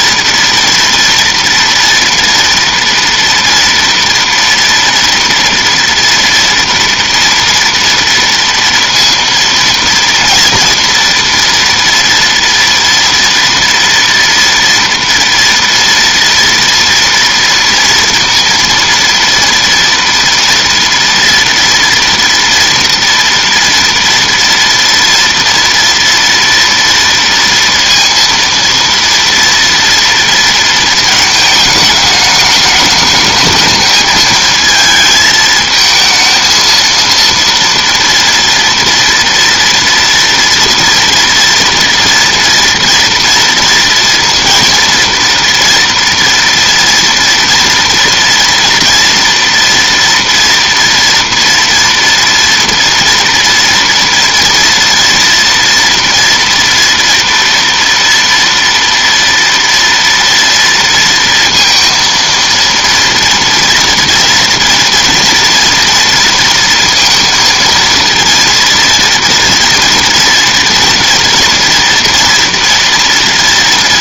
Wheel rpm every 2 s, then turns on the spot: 230, 230, 230, 230, 230, 230, 230, 230, 230, 230, 230, 230, 230, 230, 230, 230, 210, 220, 230, 230, 230, 230, 230, 230, 230, 230, 240, 230, 240, 230, 230, 230, 230, 230, 230, 230, 240.
none